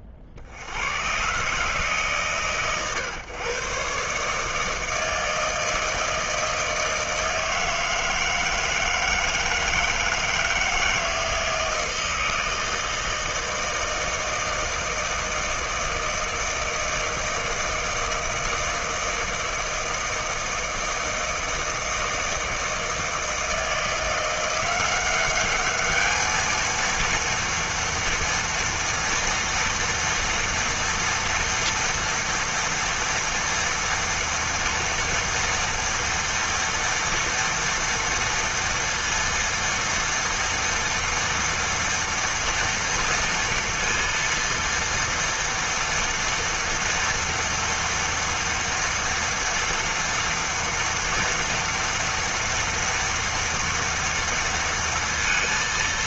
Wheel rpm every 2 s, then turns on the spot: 50, 130, 160, 160, 160, 160, 160, 160, 160, 160, 160, 160, 180, 230, 230, 230, 230, 230, 230, 230, 230, 230, 230, 230, 230, 230, 230, 230.
none